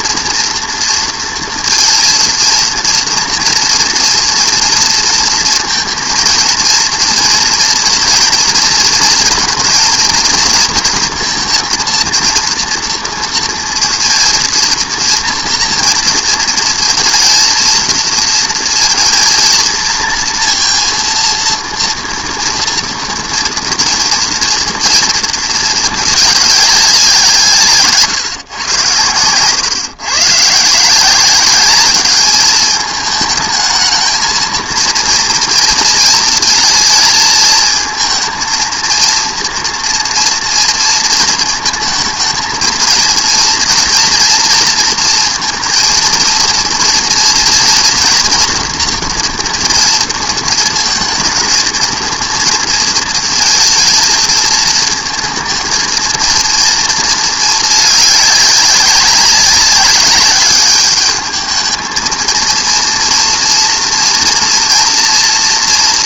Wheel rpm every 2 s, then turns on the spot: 230, 230, 230, 230, 230, 230, 230, 230, 230, 230, 230, 230, 230, 210, 110, 150, 210, 230, 230, 230, 230, 230, 230, 230, 230, 230, 230, 230, 230, 200, 210, 230, 230.
none